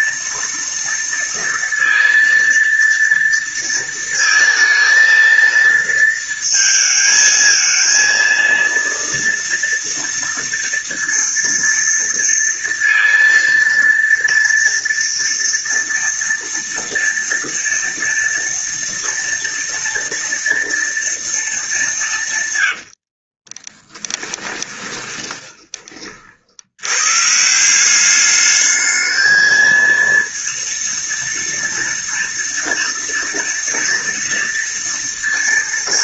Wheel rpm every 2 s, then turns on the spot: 230, 230, 230, 220, 230, 230, 230, 230, 230, 230, 230, 120, 20, 60, 210, 230, 230, 230.
22-26